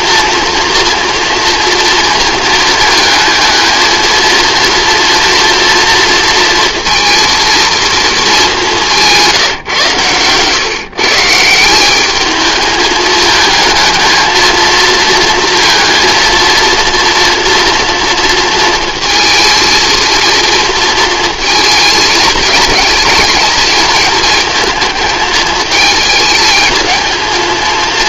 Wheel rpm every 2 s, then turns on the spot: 230, 220, 230, 230, 190, 150, 220, 230, 230, 230, 230, 210, 220, 220.
none